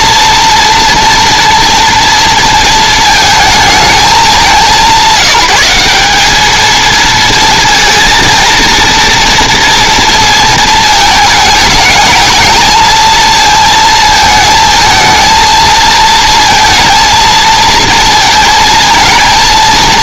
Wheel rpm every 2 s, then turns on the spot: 240, 220, 170, 230, 240, 220, 220, 220, 230, 230.
none